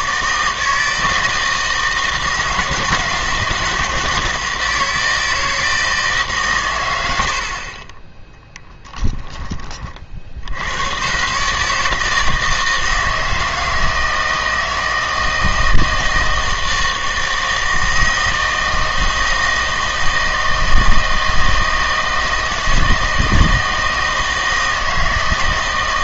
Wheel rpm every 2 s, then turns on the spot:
160, 170, 160, 120, 10, 80, 160, 160, 160, 160, 160, 160, 160.
8-10